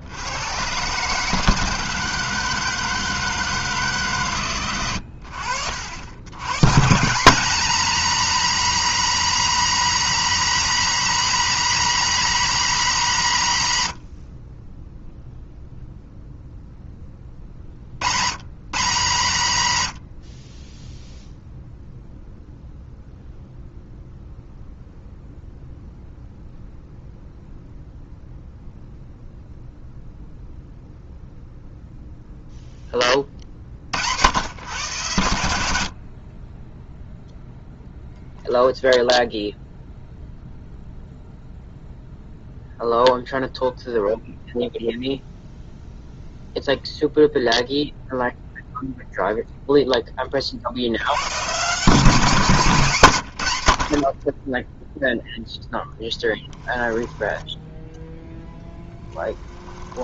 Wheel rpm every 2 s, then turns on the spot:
130, 160, 100, 170, 250, 250, 220, 0, 10, 160, 10, 0, 0, 0, 0, 0, 20, 120, 0, 0, 0, 0, 0, 0, 0, 80, 150, 0, 10, 10.
52-54 56-60